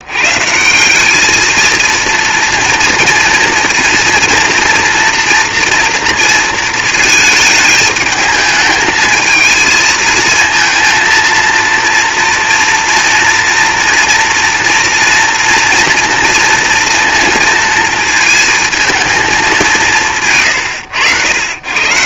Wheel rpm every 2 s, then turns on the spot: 180, 240, 240, 230, 220, 230, 230, 230, 230, 230, 90.
none